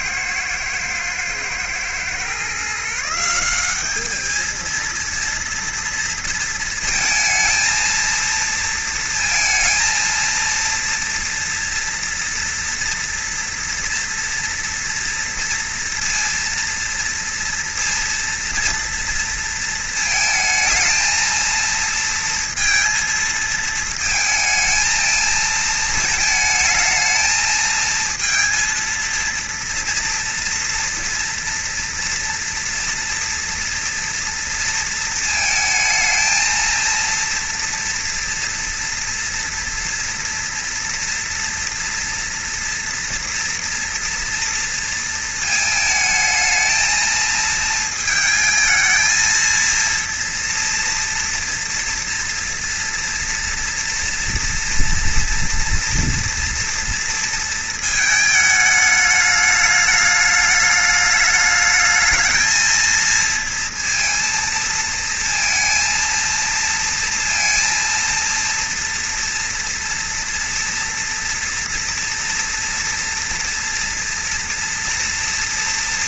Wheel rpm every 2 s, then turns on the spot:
120, 130, 220, 230, 230, 230, 230, 230, 230, 230, 220, 230, 220, 220, 230, 230, 230, 230, 230, 230, 230, 230, 230, 220, 220, 230, 230, 230, 240, 210, 210, 230, 230, 230, 230, 230, 230, 230.
none